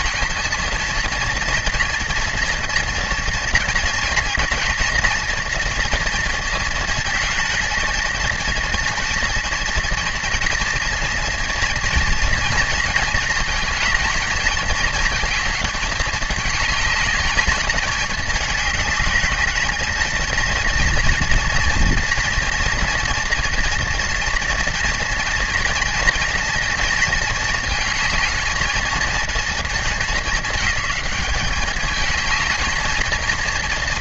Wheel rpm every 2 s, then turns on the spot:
230, 230, 240, 220, 230, 230, 230, 220, 210, 210, 230, 230, 240, 230, 220, 210, 220.
none